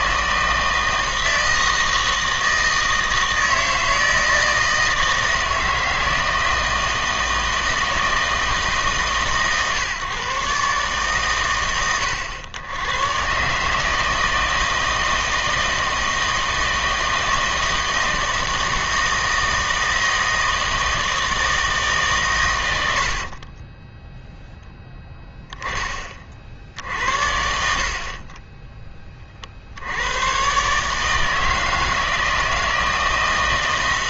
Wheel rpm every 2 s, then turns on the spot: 160, 160, 160, 160, 150, 140, 100, 160, 160, 160, 160, 100, 10, 60, 10, 140, 160.
none